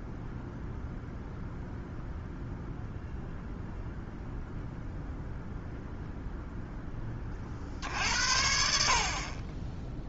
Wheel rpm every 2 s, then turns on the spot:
0, 0, 0, 10, 60.
none